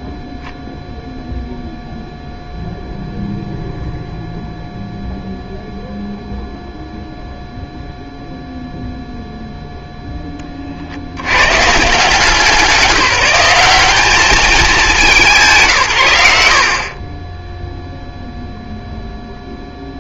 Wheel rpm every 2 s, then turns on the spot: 0, 0, 0, 0, 0, 30, 180, 200, 90, 0.
none